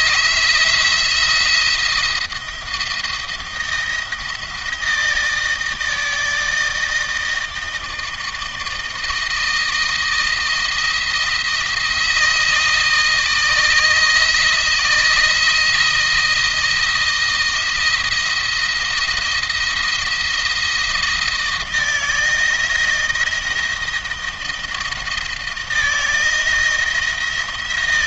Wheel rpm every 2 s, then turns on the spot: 170, 160, 160, 160, 160, 170, 160, 160, 170, 170, 170, 170, 170, 160.
none